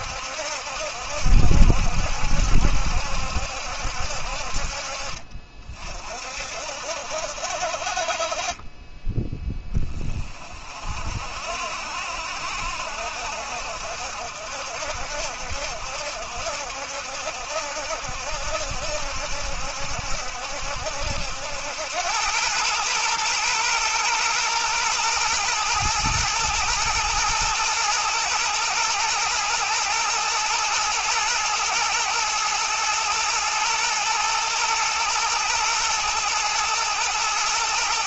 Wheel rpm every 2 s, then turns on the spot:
70, 70, 50, 60, 20, 50, 70, 60, 70, 70, 70, 110, 120, 120, 110, 120, 110, 120, 120.
none